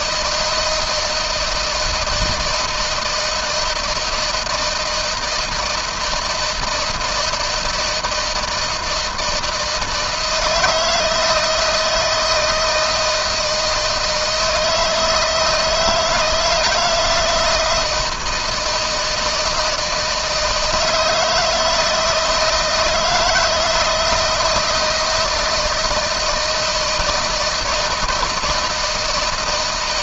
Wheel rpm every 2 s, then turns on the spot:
160, 160, 160, 160, 160, 160, 160, 160, 170, 160, 160, 160, 160, 160, 160.
none